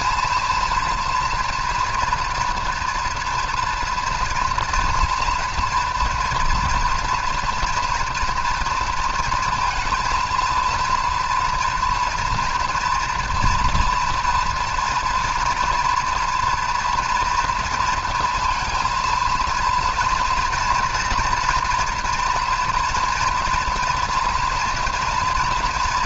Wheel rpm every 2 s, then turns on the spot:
240, 230, 230, 230, 230, 230, 230, 240, 230, 230, 240, 230, 230.
none